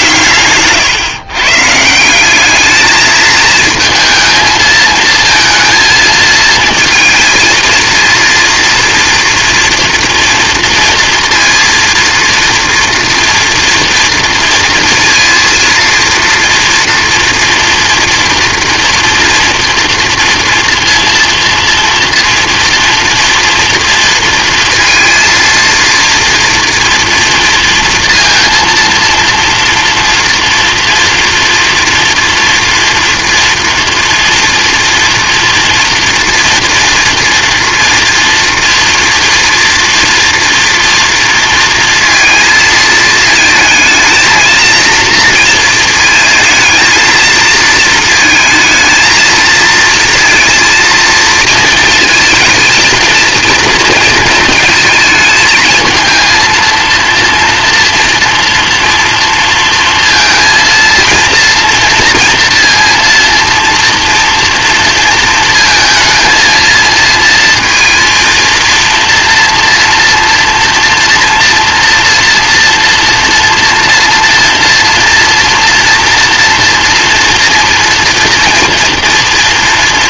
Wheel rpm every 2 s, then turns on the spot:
130, 210, 220, 220, 230, 230, 230, 230, 230, 240, 230, 230, 230, 230, 230, 230, 230, 240, 230, 240, 240, 220, 230, 230, 220, 230, 230, 230, 230, 230, 230, 230, 230, 230, 230, 230, 230, 230, 230, 230.
0-2